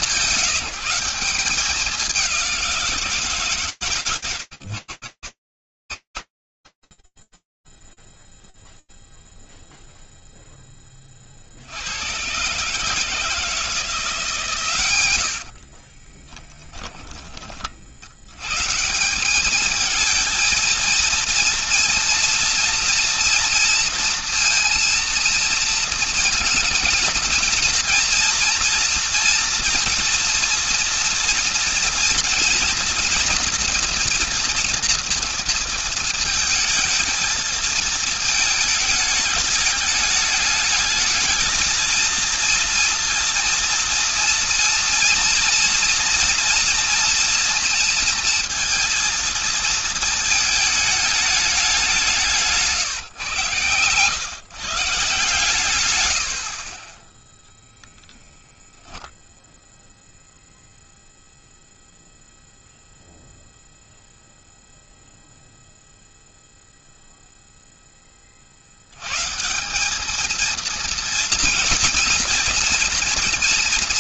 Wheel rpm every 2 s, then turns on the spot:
190, 190, 130, 40, 0, 10, 120, 140, 20, 150, 230, 240, 230, 230, 230, 230, 240, 240, 230, 210, 210, 230, 240, 230, 230, 220, 140, 140, 10, 0, 0, 0, 0, 0, 140, 230, 230.
16-18